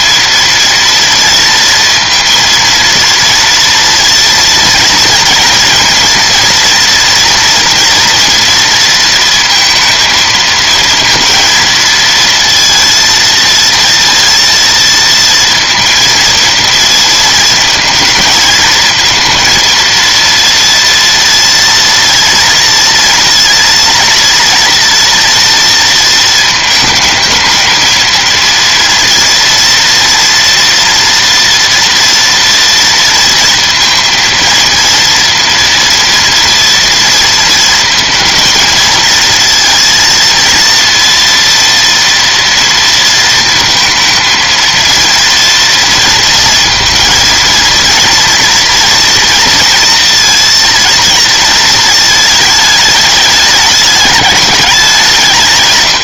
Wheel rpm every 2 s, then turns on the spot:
230, 230, 230, 230, 230, 220, 230, 230, 220, 230, 230, 230, 230, 220, 230, 230, 230, 230, 230, 220, 230, 230, 230, 230, 240, 230, 210, 190.
none